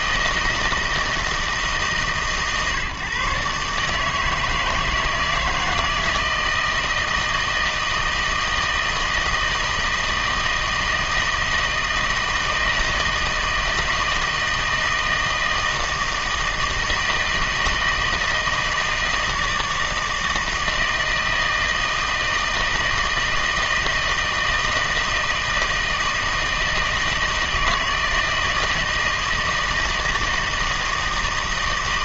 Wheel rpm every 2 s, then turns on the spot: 160, 140, 160, 160, 160, 160, 160, 160, 160, 160, 160, 160, 160, 160, 160, 160.
none